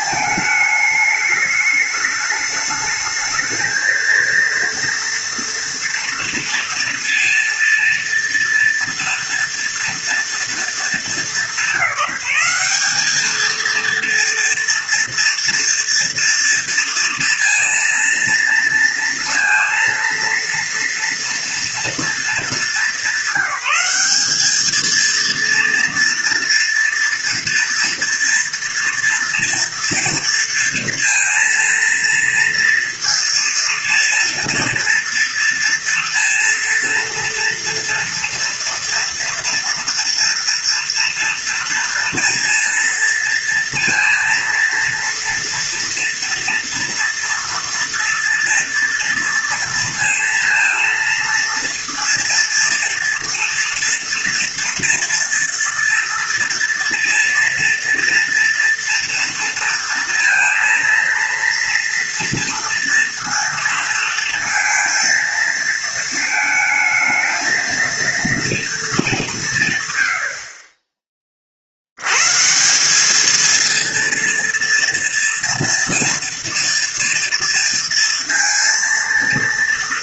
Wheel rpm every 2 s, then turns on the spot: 210, 210, 230, 230, 230, 210, 210, 240, 230, 230, 240, 200, 220, 230, 230, 230, 230, 230, 230, 230, 230, 230, 230, 230, 230, 230, 230, 230, 230, 230, 230, 230, 230, 220, 210, 30, 200, 230, 230, 230.
none